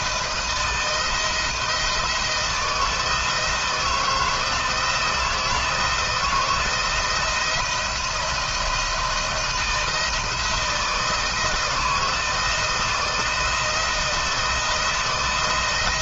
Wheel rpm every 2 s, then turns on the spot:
170, 160, 170, 170, 170, 160, 170, 170.
none